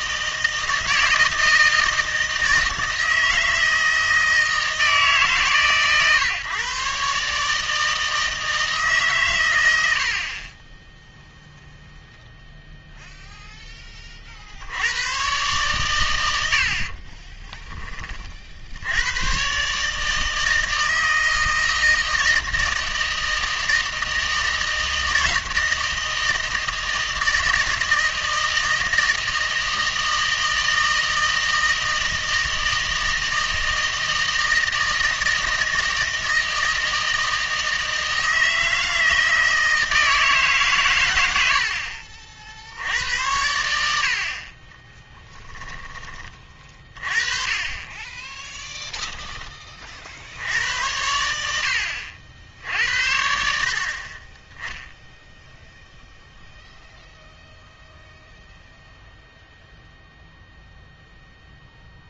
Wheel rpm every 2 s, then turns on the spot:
160, 160, 160, 140, 150, 10, 0, 90, 70, 80, 160, 160, 160, 160, 160, 160, 160, 160, 160, 160, 130, 70, 30, 30, 0, 90, 70, 10, 0, 0, 0.
44-46